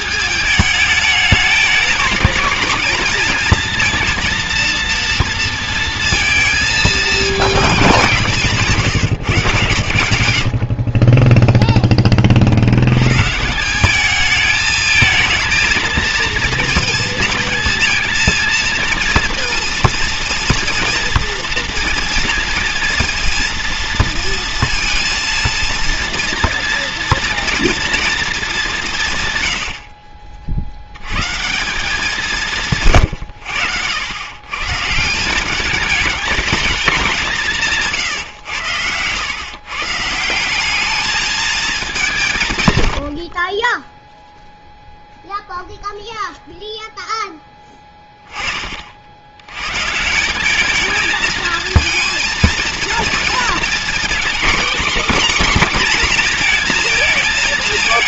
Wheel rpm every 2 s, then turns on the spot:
210, 220, 230, 220, 180, 70, 60, 210, 230, 230, 230, 230, 230, 230, 200, 60, 160, 120, 210, 110, 190, 140, 0, 0, 20, 200, 220, 250, 230.
8-10